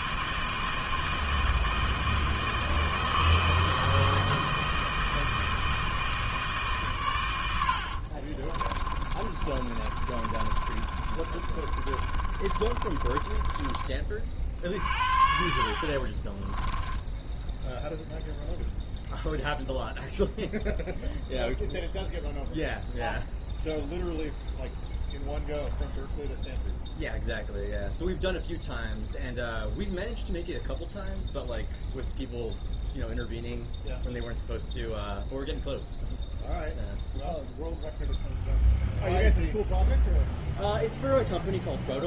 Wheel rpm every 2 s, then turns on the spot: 160, 160, 160, 130, 30, 40, 30, 50, 10, 0, 0, 0, 0, 0, 0, 0, 0, 0, 0, 0, 0.
8-14 16-18